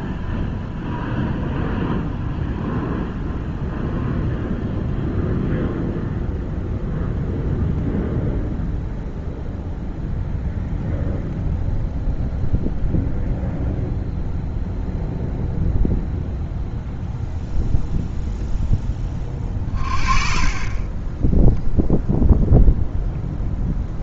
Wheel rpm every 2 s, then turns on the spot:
0, 0, 0, 0, 0, 0, 0, 0, 0, 10, 30, 0.
none